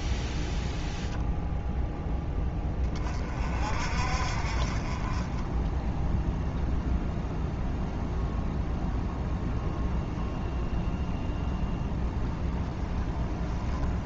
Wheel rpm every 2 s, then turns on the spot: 0, 20, 30, 0, 0, 0, 0.
none